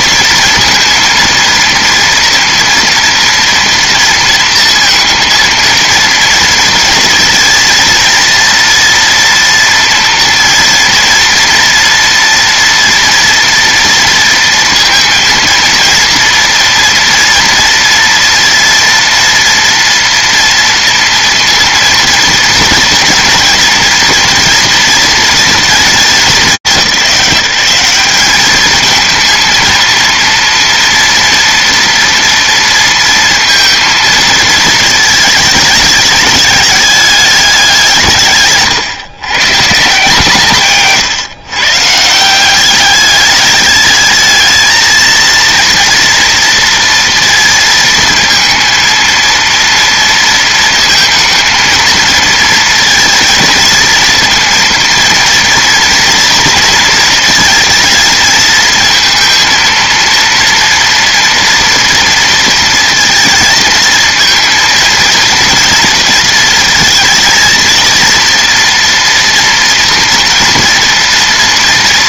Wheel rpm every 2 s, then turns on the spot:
230, 230, 230, 230, 230, 230, 240, 230, 230, 240, 230, 230, 230, 180, 210, 230, 230, 230, 210, 150, 150, 190, 220, 230, 230, 230, 230, 230, 230, 230, 230, 230, 230, 230, 230, 230.
none